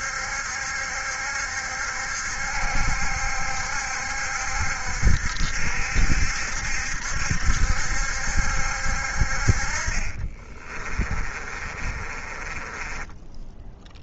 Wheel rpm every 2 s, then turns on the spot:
70, 70, 70, 70, 70, 30, 20.
10-14